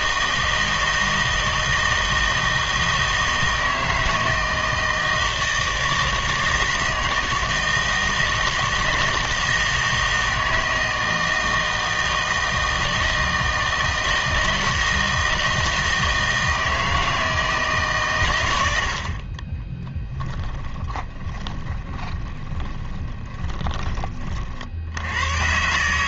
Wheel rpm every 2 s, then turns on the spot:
160, 160, 160, 160, 160, 160, 160, 160, 160, 90, 20, 20, 70.
20-24